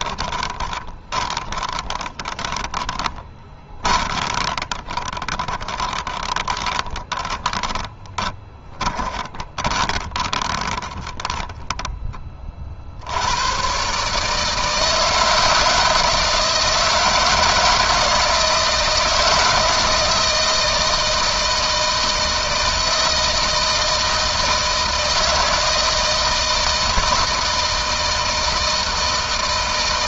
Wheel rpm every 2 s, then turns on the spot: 20, 20, 20, 20, 20, 20, 40, 160, 160, 160, 160, 160, 160, 160, 160.
0-12